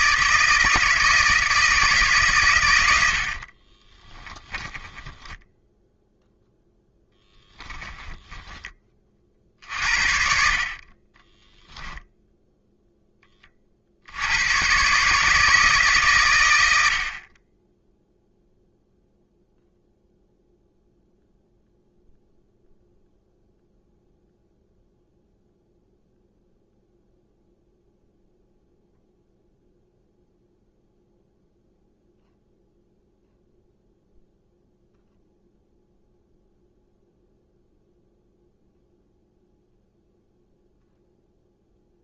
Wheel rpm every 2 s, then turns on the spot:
160, 90, 10, 10, 20, 30, 10, 130, 60, 0, 0, 0, 0, 0, 0, 0, 0, 0, 0, 0, 0.
4-8